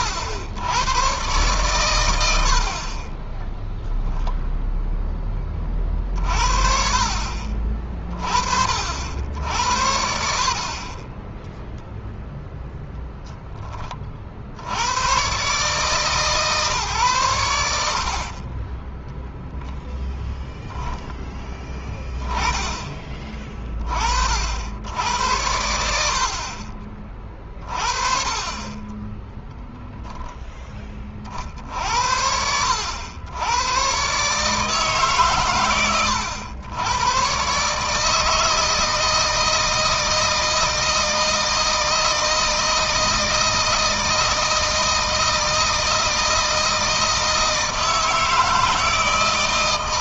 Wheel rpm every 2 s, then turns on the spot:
100, 50, 0, 40, 50, 30, 0, 60, 140, 20, 0, 20, 80, 40, 20, 20, 80, 150, 110, 160, 160, 160, 160, 160, 160.
none